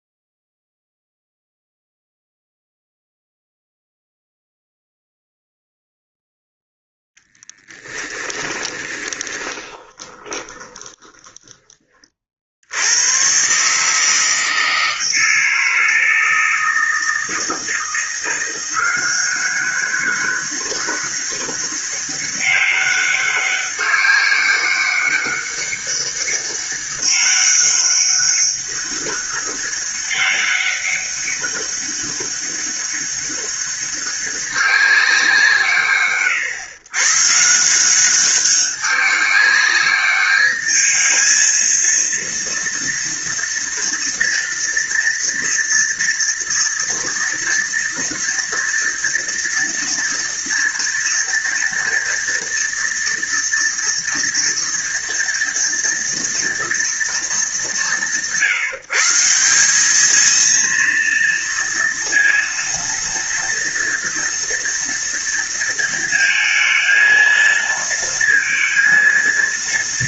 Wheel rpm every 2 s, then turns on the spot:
0, 0, 0, 0, 30, 20, 40, 160, 160, 170, 200, 200, 200, 200, 200, 200, 200, 200, 130, 190, 210, 230, 230, 230, 230, 230, 230, 230, 230, 160, 220, 230, 230, 220, 230.
8-12